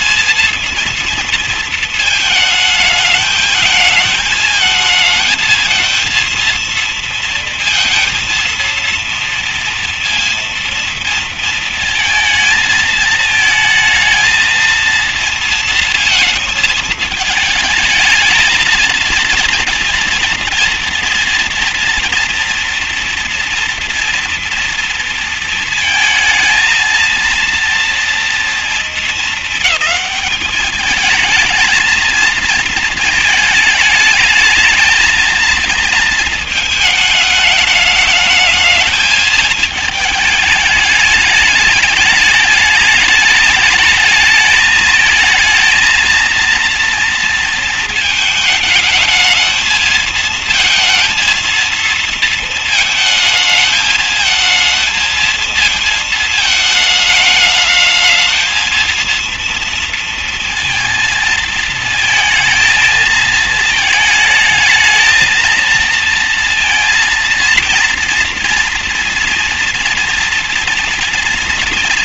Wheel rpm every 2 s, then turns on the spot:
230, 220, 220, 230, 230, 230, 220, 230, 220, 220, 230, 230, 240, 220, 230, 210, 220, 210, 220, 210, 220, 210, 220, 230, 220, 230, 220, 220, 220, 220, 230, 220, 220, 230, 230, 230.
none